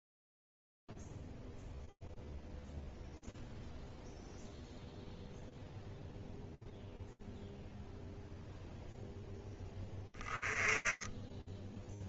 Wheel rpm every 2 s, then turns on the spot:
0, 0, 0, 0, 0, 10.
none